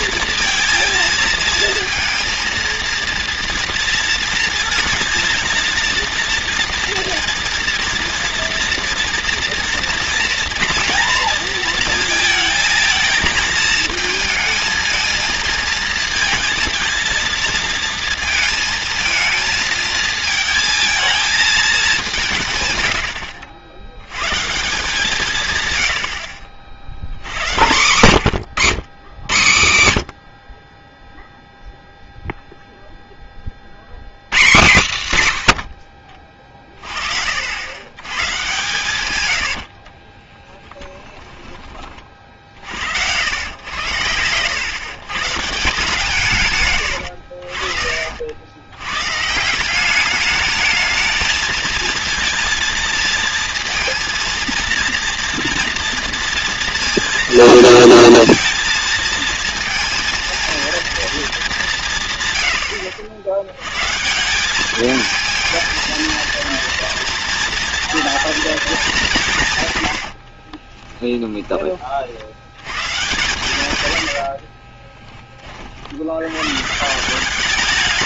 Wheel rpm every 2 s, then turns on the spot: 230, 220, 230, 230, 240, 230, 220, 230, 230, 230, 220, 110, 150, 90, 140, 30, 0, 130, 40, 130, 30, 60, 130, 110, 100, 210, 230, 240, 230, 230, 230, 80, 210, 230, 220, 20, 110, 30, 150.
22-24 40-42 70-72 74-76